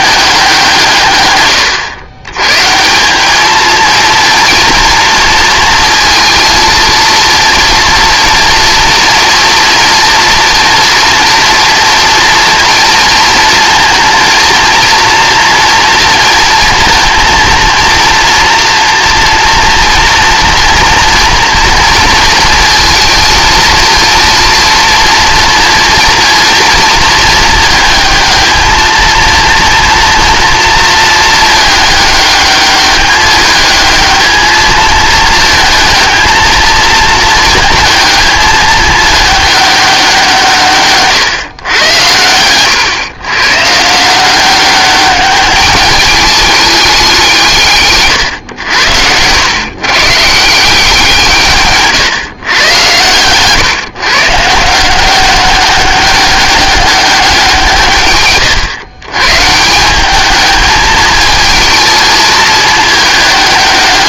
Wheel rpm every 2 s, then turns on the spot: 170, 150, 230, 230, 230, 230, 230, 230, 230, 230, 230, 230, 230, 230, 220, 230, 210, 220, 220, 220, 150, 110, 190, 210, 100, 170, 120, 160, 200, 130, 220, 220.
none